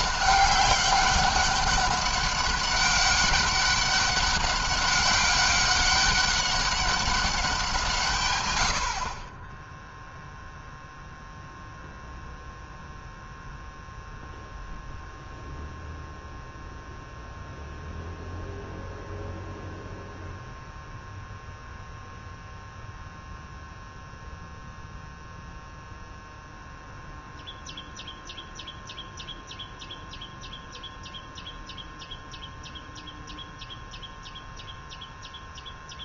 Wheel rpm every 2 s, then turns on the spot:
200, 200, 200, 190, 50, 0, 0, 0, 0, 0, 0, 0, 0, 0, 0, 0, 0, 0.
none